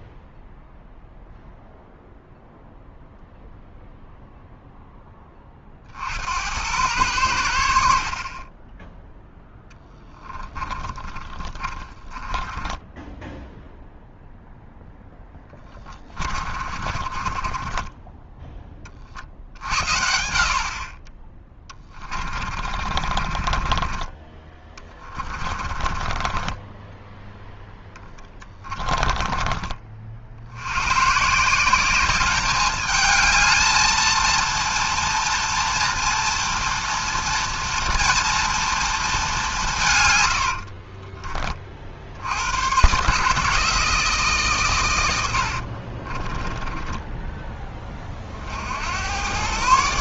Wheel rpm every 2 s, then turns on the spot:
0, 0, 0, 90, 10, 20, 10, 10, 40, 20, 40, 40, 30, 10, 20, 90, 210, 230, 240, 230, 60, 120, 120, 10, 70.
10-14 16-18 22-30 40-42 46-48